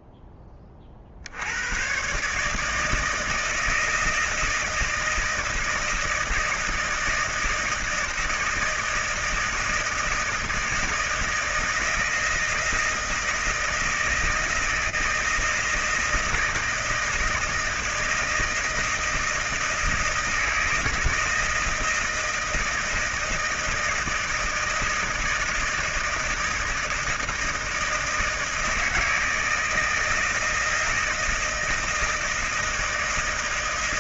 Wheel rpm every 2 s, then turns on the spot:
30, 150, 160, 160, 160, 160, 160, 160, 160, 160, 160, 160, 160, 160, 160, 160, 160.
none